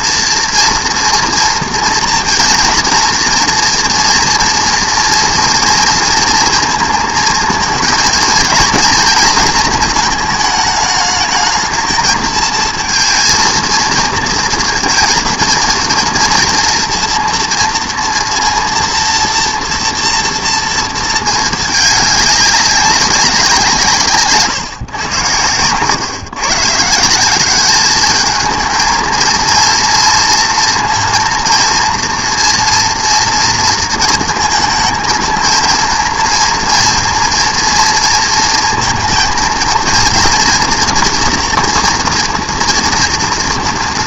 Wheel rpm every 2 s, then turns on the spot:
230, 230, 230, 230, 220, 210, 220, 230, 230, 230, 230, 200, 130, 140, 220, 230, 240, 220, 230, 230, 230, 230.
24-26